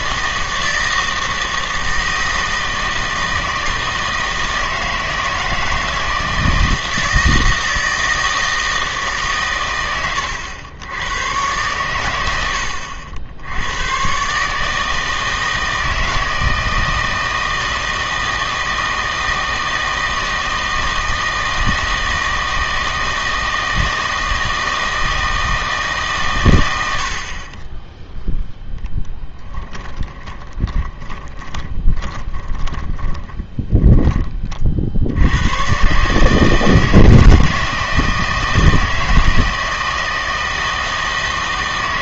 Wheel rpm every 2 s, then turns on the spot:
160, 160, 160, 160, 160, 90, 90, 150, 160, 160, 160, 160, 160, 100, 0, 20, 30, 30, 160, 160, 160.
30-34